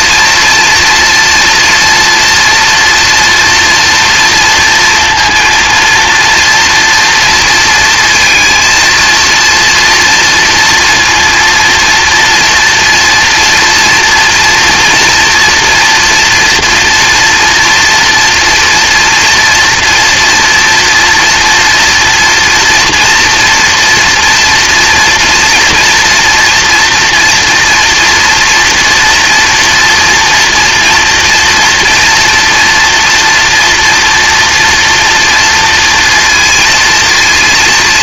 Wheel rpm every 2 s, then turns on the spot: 240, 230, 230, 230, 230, 240, 230, 240, 230, 240, 230, 240, 240, 230, 230, 230, 230, 240, 230.
none